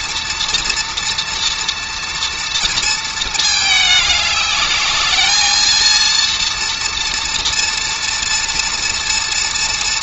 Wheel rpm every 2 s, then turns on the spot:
230, 230, 210, 230, 230.
none